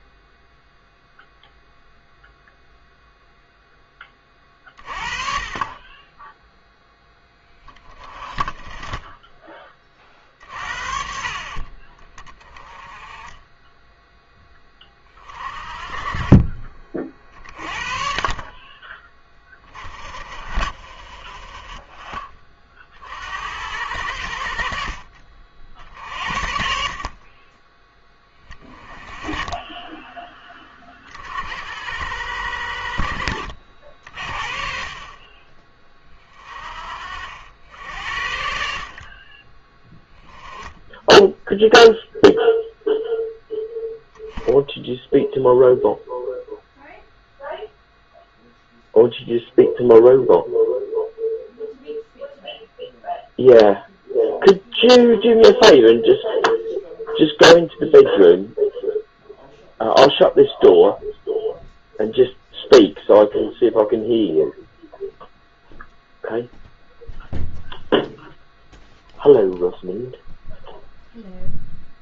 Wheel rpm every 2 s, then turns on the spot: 0, 0, 30, 10, 20, 50, 20, 20, 30, 20, 30, 40, 50, 50, 20, 20, 60, 30, 40, 50, 10, 0, 0, 0, 0, 0, 0, 0, 0, 0, 0, 0, 0, 0, 0, 0.
none